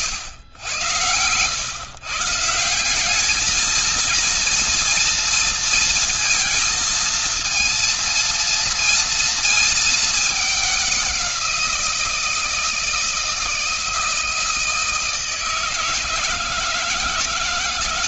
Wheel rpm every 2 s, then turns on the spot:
110, 150, 230, 230, 230, 210, 170, 160, 160.
none